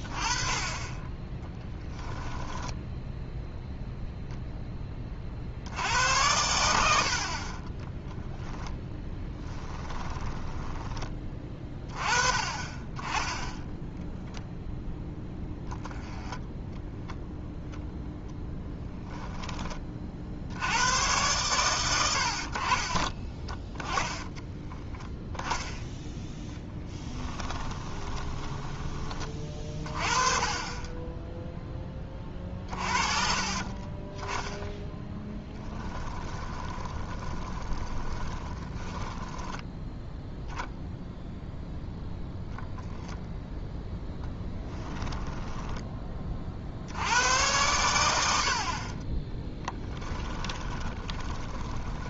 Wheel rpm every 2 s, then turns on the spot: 20, 10, 20, 60, 10, 20, 20, 0, 0, 10, 90, 40, 10, 10, 20, 20, 30, 10, 20, 20, 0, 0, 10, 70, 50, 20.
2-4 8-10 26-28 32-40 50-52